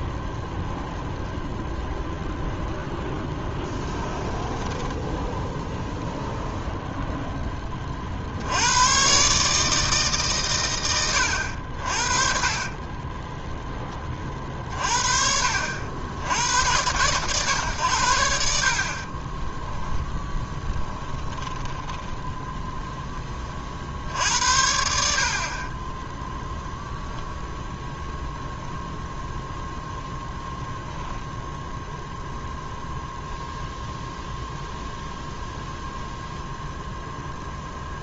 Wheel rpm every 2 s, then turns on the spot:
0, 0, 10, 0, 100, 110, 30, 40, 100, 50, 10, 0, 80, 0, 0, 0, 0, 0, 0.
4-6 12-14 20-22